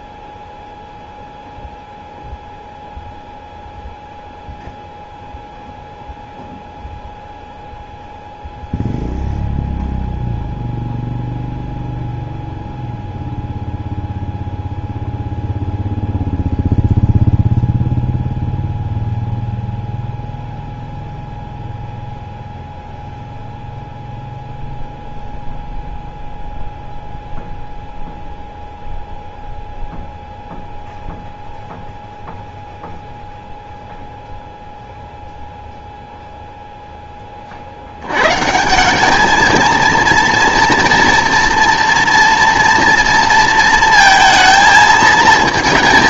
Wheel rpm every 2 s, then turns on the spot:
0, 0, 0, 0, 0, 0, 0, 0, 0, 0, 0, 0, 0, 0, 0, 0, 0, 0, 0, 170, 240, 230, 230.
none